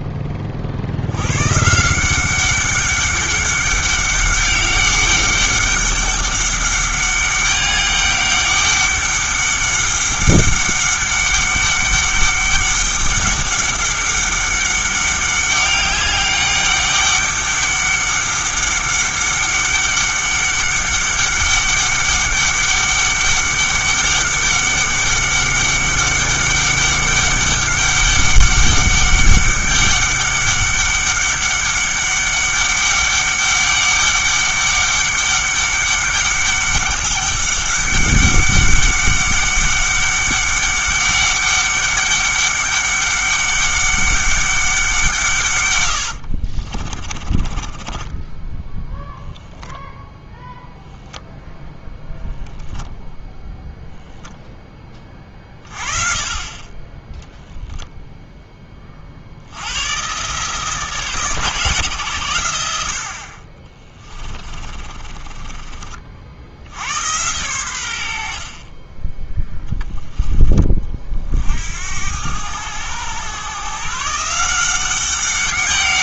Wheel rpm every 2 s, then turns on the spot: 50, 200, 200, 200, 200, 200, 200, 200, 200, 200, 200, 200, 200, 200, 200, 200, 200, 200, 200, 200, 200, 200, 190, 40, 10, 0, 0, 10, 20, 20, 150, 90, 30, 80, 40, 30, 100, 180.
46-48 64-66